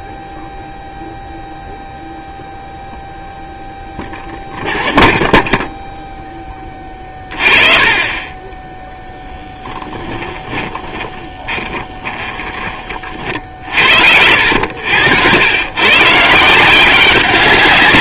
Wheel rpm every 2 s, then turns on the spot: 0, 0, 0, 20, 10, 20, 20, 80, 180.
10-12